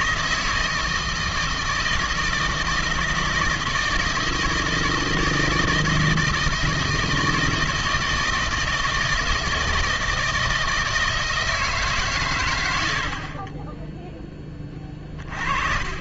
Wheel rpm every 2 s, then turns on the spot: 160, 160, 160, 160, 160, 160, 120, 20.
none